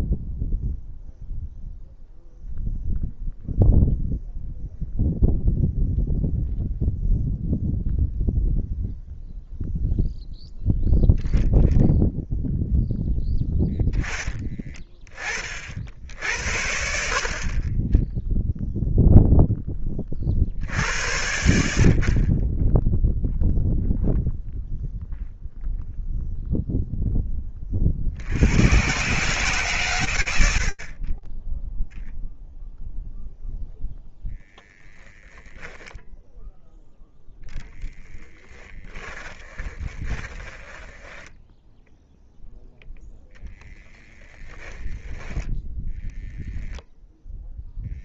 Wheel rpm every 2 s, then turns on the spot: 0, 0, 0, 0, 0, 0, 0, 10, 60, 0, 60, 30, 0, 0, 80, 70, 0, 10, 0, 10, 10, 0, 10, 10.
38-42 44-46